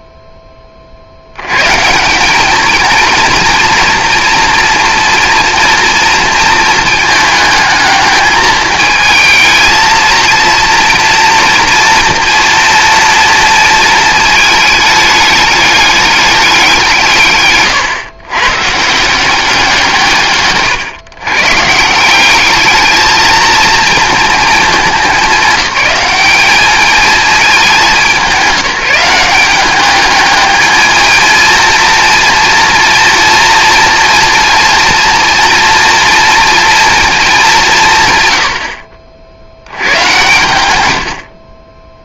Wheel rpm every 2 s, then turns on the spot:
30, 220, 240, 220, 220, 230, 230, 210, 180, 140, 130, 210, 210, 210, 190, 220, 230, 230, 230, 70, 100.
20-22